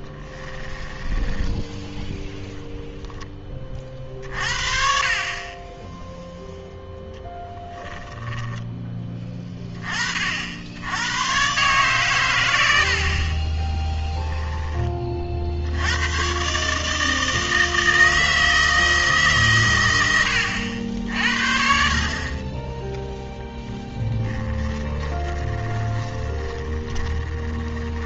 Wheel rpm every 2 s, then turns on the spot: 10, 0, 50, 0, 10, 80, 80, 20, 140, 160, 70, 10, 20, 10.
0-2 24-28